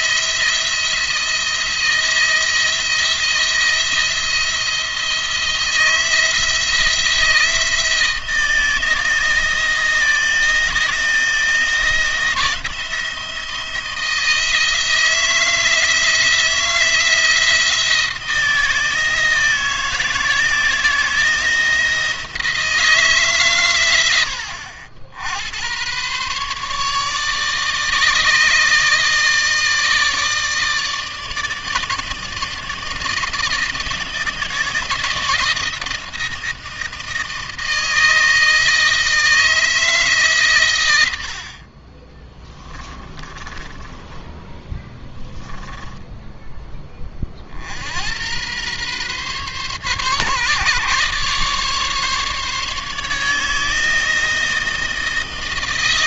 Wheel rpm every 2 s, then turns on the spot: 170, 170, 170, 170, 160, 160, 170, 160, 170, 160, 160, 160, 70, 150, 150, 160, 160, 160, 160, 160, 100, 30, 20, 20, 120, 140, 150, 160.
42-46